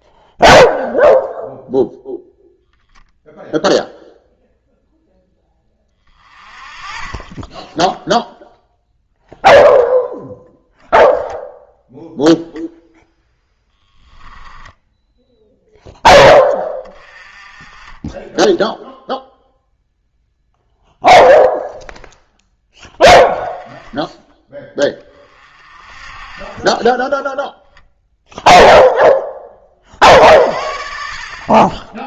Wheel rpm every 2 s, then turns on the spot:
0, 0, 0, 30, 0, 10, 0, 10, 20, 0, 0, 10, 20, 20, 0, 50.
14-16